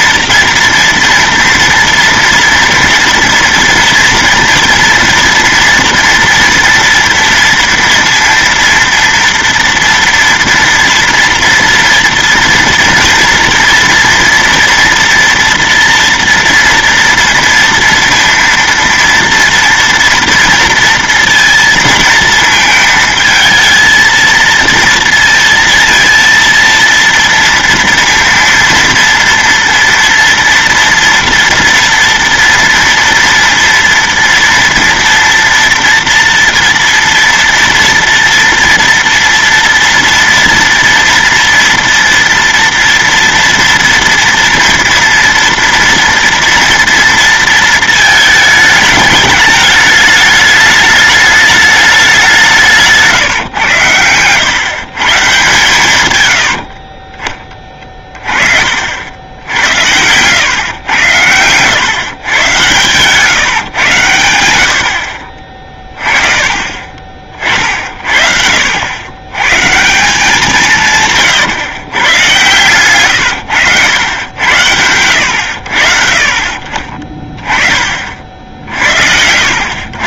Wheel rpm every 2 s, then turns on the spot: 230, 230, 240, 230, 230, 230, 230, 230, 230, 230, 230, 230, 230, 230, 230, 230, 230, 240, 230, 230, 230, 230, 230, 230, 210, 210, 180, 140, 60, 50, 110, 120, 70, 30, 70, 170, 120, 90, 30, 60.
56-58 60-62